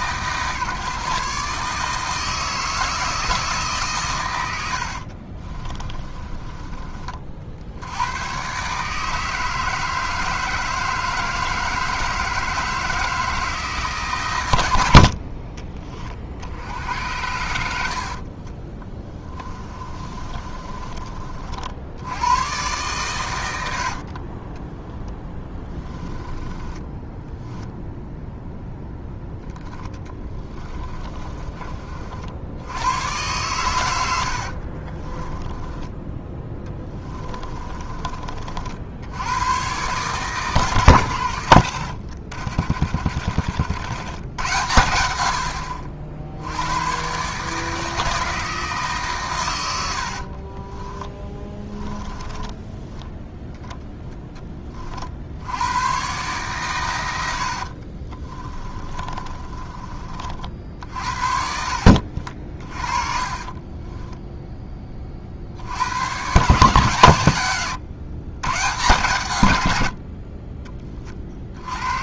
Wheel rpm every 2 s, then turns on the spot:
150, 160, 70, 30, 140, 160, 160, 80, 80, 20, 30, 120, 10, 10, 0, 20, 100, 40, 10, 70, 110, 40, 100, 100, 150, 10, 10, 30, 110, 30, 60, 30, 20, 130, 130, 30.
4-6 18-20 24-28 30-32 34-38 42-44 50-52 58-64